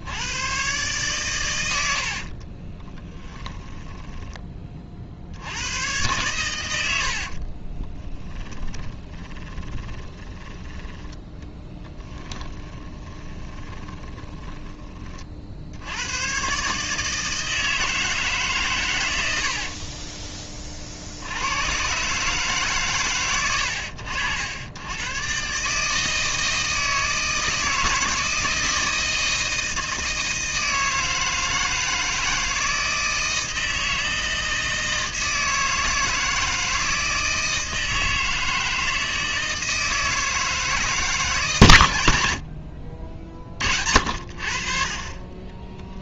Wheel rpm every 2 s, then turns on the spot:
130, 30, 40, 80, 20, 10, 20, 20, 150, 120, 50, 130, 100, 160, 160, 160, 160, 160, 160, 160, 160, 50, 40.
2-4 8-10 12-14